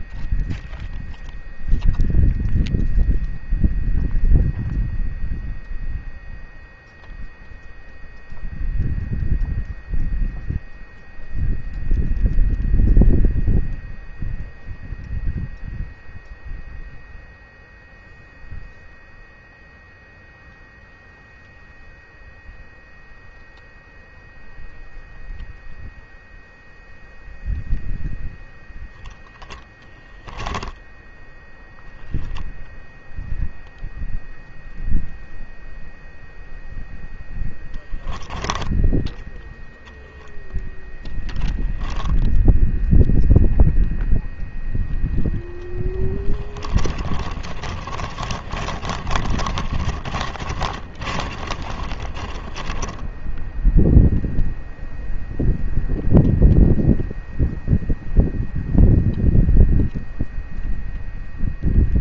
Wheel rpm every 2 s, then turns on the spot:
0, 0, 0, 0, 0, 0, 0, 0, 0, 0, 0, 0, 0, 0, 0, 10, 0, 0, 0, 10, 0, 0, 0, 30, 40, 40, 30, 0, 0, 0, 0.
38-40 46-54